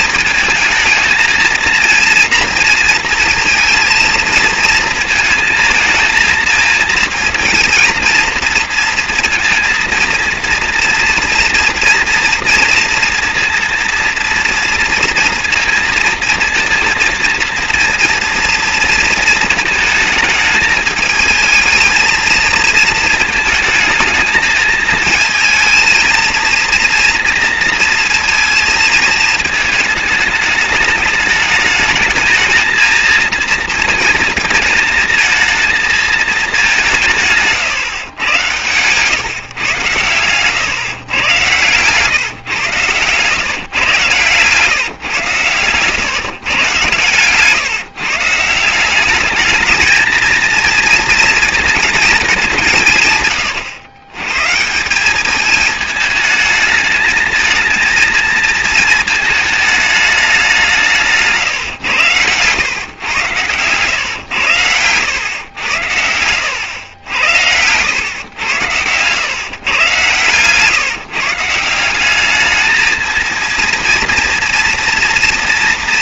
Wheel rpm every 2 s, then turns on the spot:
220, 230, 230, 220, 230, 230, 230, 230, 230, 240, 220, 220, 220, 230, 220, 210, 230, 220, 210, 120, 130, 130, 140, 120, 170, 230, 190, 160, 220, 220, 190, 110, 110, 90, 110, 140, 210, 230.
none